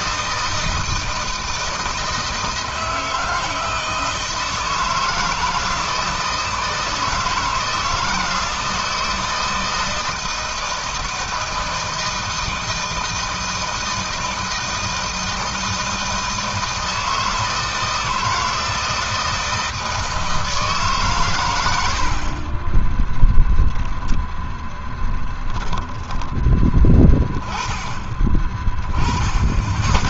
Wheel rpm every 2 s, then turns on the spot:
160, 160, 160, 160, 160, 160, 160, 160, 160, 160, 160, 40, 0, 10, 20.
none